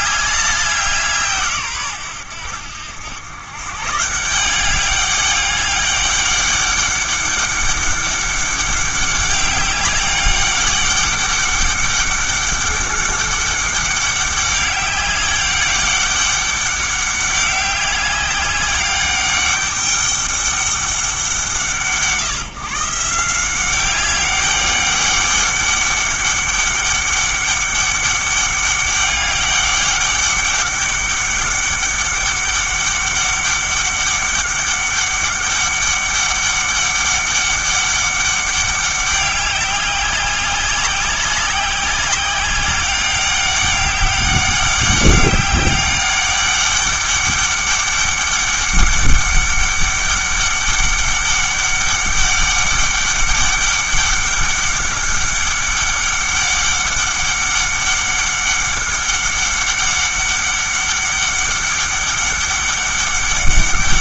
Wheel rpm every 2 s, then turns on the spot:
190, 90, 190, 200, 200, 200, 200, 200, 200, 200, 200, 160, 200, 200, 200, 200, 200, 200, 200, 200, 190, 200, 200, 200, 200, 200, 200, 200, 200, 200, 200, 200.
none